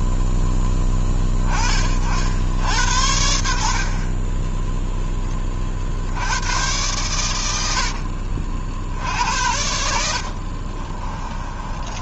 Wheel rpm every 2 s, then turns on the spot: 10, 70, 10, 110, 70, 30.
10-12